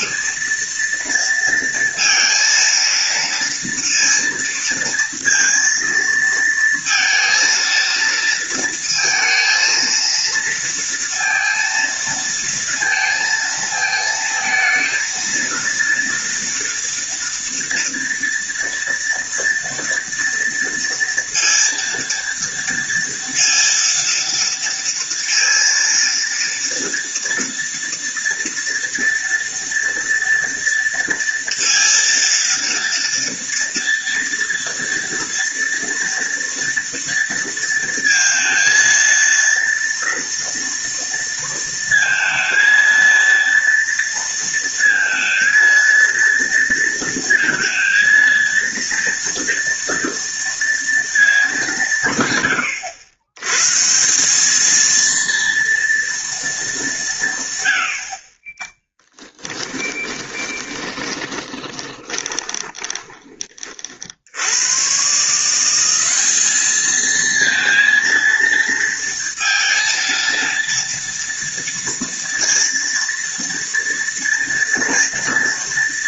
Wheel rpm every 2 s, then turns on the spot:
230, 230, 230, 230, 230, 230, 230, 230, 230, 230, 230, 230, 230, 230, 230, 230, 230, 230, 230, 230, 230, 230, 230, 230, 230, 230, 110, 220, 210, 20, 20, 20, 100, 210, 230, 230, 230, 230.
60-64